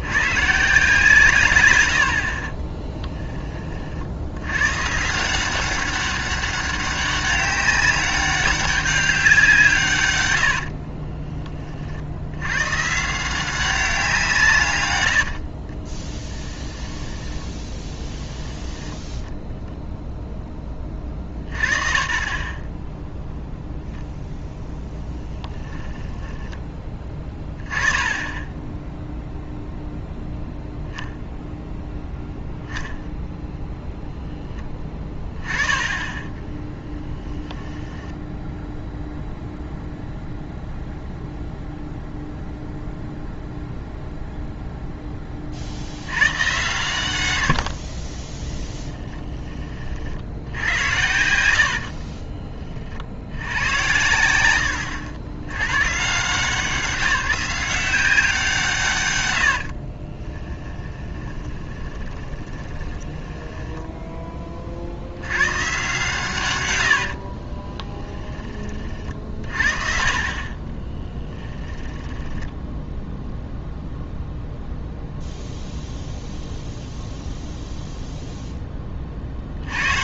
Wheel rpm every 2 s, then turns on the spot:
140, 20, 140, 200, 200, 60, 130, 120, 10, 0, 30, 20, 10, 10, 0, 0, 10, 10, 10, 0, 0, 0, 0, 110, 20, 80, 40, 80, 170, 150, 10, 20, 60, 80, 30, 20, 10, 0, 0, 20.
2-4 10-12 16-18 24-26 36-38 48-50 54-56 60-64 66-68 70-74